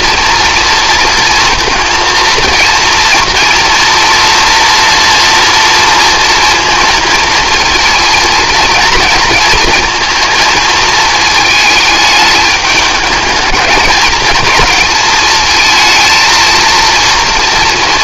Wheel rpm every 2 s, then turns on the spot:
240, 230, 230, 230, 220, 230, 210, 230, 230.
none